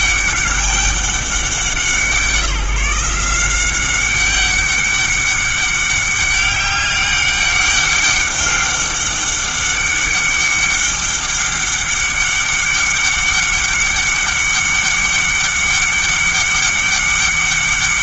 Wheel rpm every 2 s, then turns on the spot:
200, 170, 200, 200, 200, 200, 200, 200, 200.
none